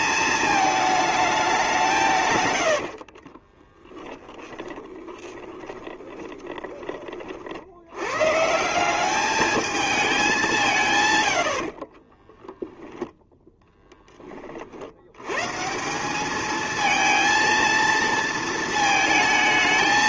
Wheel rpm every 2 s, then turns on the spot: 220, 110, 10, 20, 150, 180, 10, 30, 210, 220.
2-8 12-14